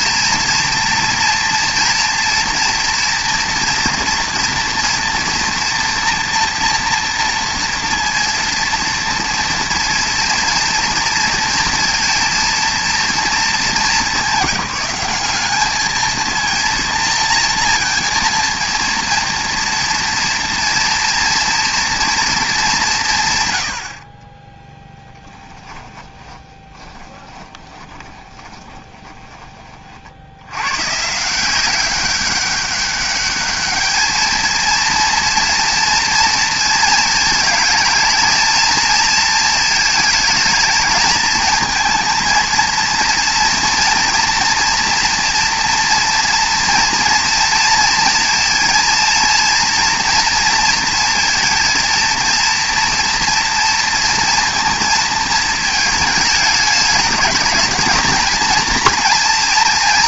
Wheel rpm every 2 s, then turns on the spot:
230, 230, 230, 230, 230, 230, 230, 190, 230, 230, 230, 210, 20, 20, 20, 100, 200, 230, 230, 220, 220, 230, 230, 230, 230, 230, 230, 230, 210, 230.
24-30